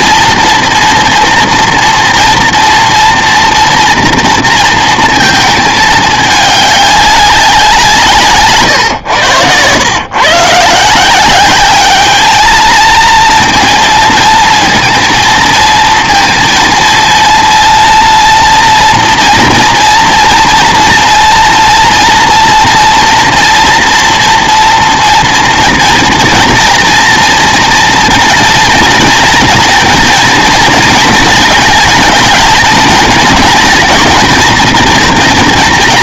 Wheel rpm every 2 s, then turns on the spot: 230, 230, 230, 200, 130, 160, 230, 230, 230, 230, 230, 230, 230, 230, 230, 230, 220, 230.
8-10